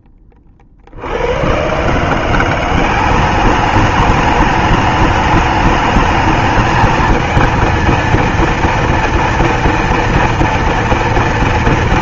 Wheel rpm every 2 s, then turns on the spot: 20, 160, 210, 210, 230, 230.
none